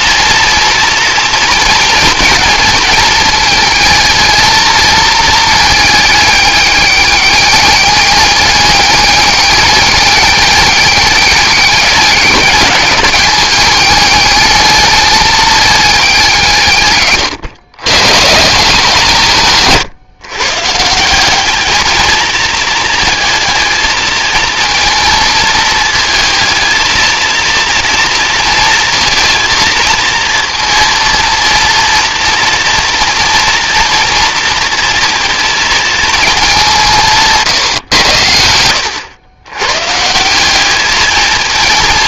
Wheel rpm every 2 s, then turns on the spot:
230, 220, 220, 210, 200, 200, 210, 210, 180, 140, 140, 220, 220, 220, 230, 230, 230, 240, 210, 90, 180.
none